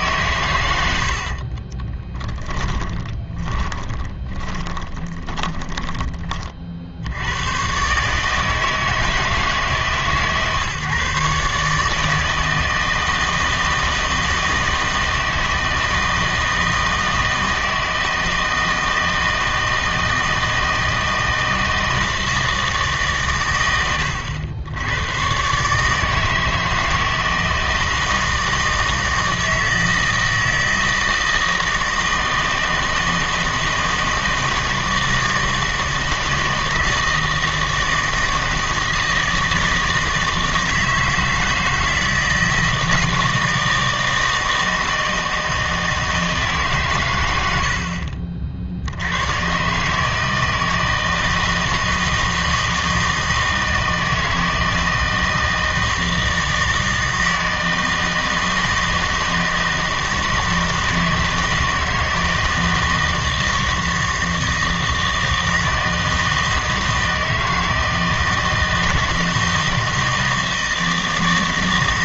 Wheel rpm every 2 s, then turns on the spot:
100, 20, 20, 50, 160, 140, 160, 160, 160, 160, 160, 160, 90, 160, 160, 160, 160, 160, 160, 160, 160, 160, 160, 140, 60, 160, 160, 160, 160, 160, 160, 160, 160, 160, 160, 160.
2-6